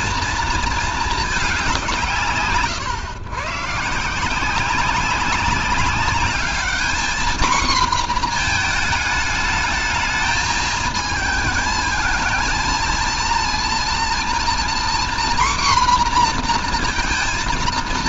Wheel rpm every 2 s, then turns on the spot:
230, 140, 190, 220, 230, 220, 230, 240, 230.
none